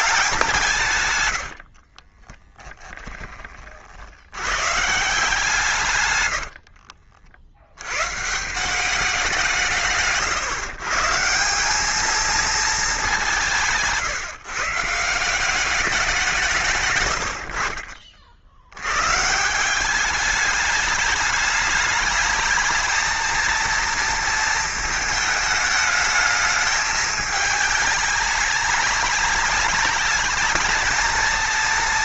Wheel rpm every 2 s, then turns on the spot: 160, 10, 130, 60, 170, 140, 210, 160, 150, 90, 210, 220, 220, 210, 210, 220.
6-8